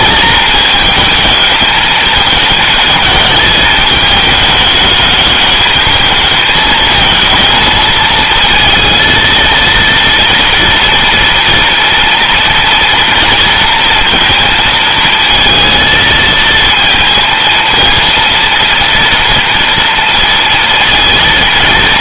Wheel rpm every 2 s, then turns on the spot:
220, 220, 210, 220, 230, 240, 230, 230, 230, 230, 230.
none